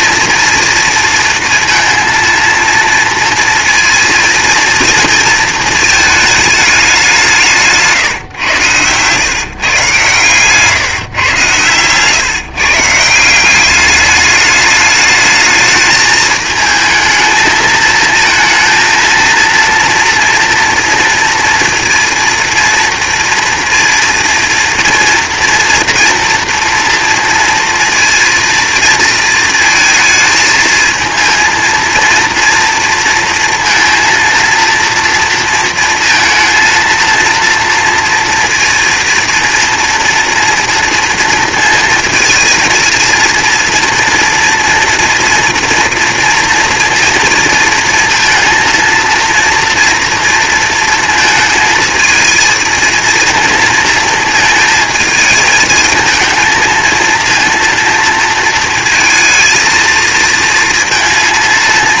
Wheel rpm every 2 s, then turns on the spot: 230, 230, 230, 190, 130, 140, 170, 210, 220, 230, 230, 230, 230, 230, 230, 220, 230, 230, 230, 230, 230, 230, 230, 230, 230, 230, 230, 220, 230, 230, 230.
none